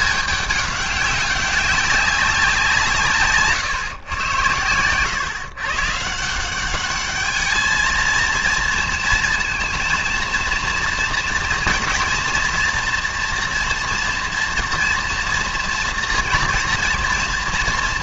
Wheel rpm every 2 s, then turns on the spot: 200, 160, 100, 190, 230, 230, 240, 240, 230.
none